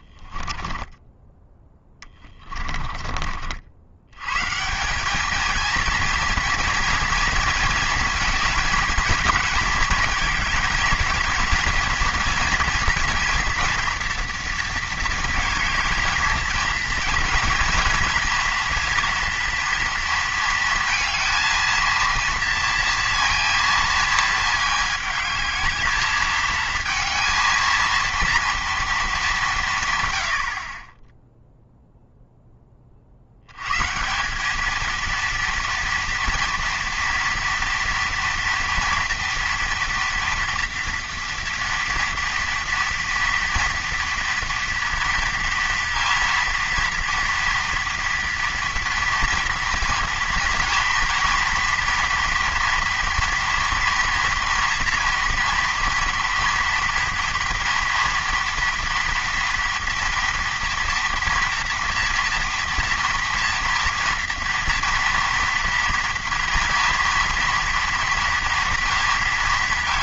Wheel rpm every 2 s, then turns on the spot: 10, 20, 160, 230, 220, 230, 230, 230, 220, 230, 230, 230, 220, 220, 230, 30, 10, 200, 230, 230, 230, 240, 230, 230, 230, 240, 240, 230, 230, 230, 230, 230, 230, 230, 230.
0-4